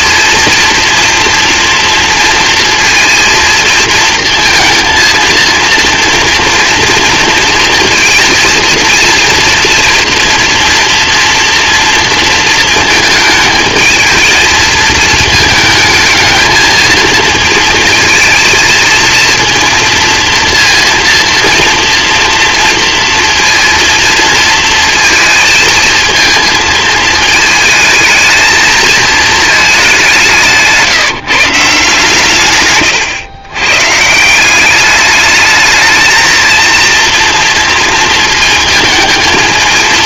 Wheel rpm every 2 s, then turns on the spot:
230, 230, 230, 230, 230, 230, 220, 220, 220, 220, 230, 230, 230, 230, 220, 160, 130, 190, 230, 220.
32-34